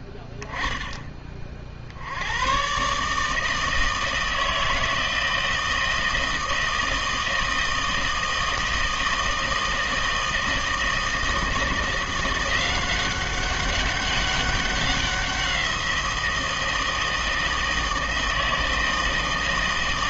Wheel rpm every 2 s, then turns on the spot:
10, 120, 160, 160, 160, 160, 180, 200, 170, 160.
none